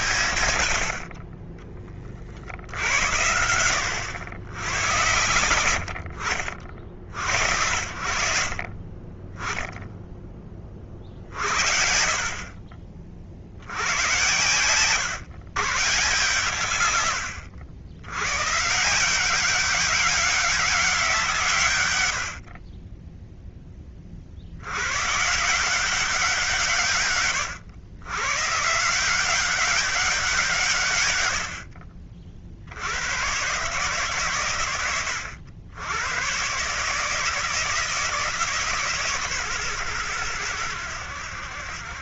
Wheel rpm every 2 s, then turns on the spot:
90, 60, 90, 50, 50, 30, 50, 120, 120, 140, 190, 40, 80, 160, 130, 160, 60, 110, 130, 160, 100.
none